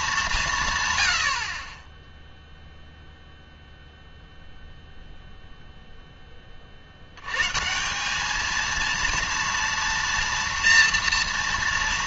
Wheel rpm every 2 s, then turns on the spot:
140, 0, 0, 50, 230, 230.
none